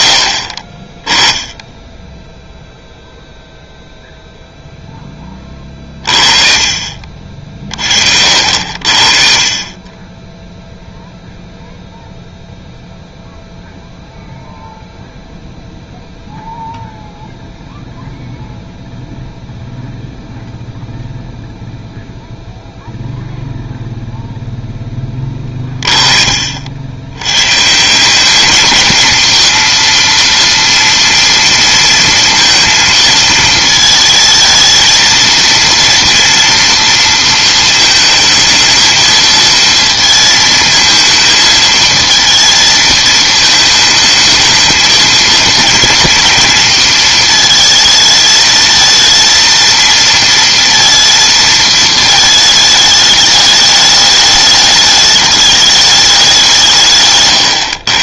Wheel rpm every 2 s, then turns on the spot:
50, 0, 0, 40, 70, 0, 0, 0, 0, 0, 0, 0, 0, 50, 210, 230, 230, 220, 230, 220, 220, 230, 220, 230, 220, 230, 220, 210, 180.
none